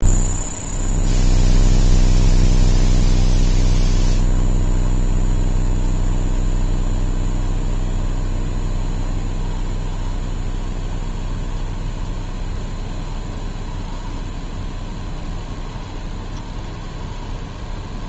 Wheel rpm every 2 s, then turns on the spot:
0, 0, 0, 0, 0, 0, 0, 0, 0.
none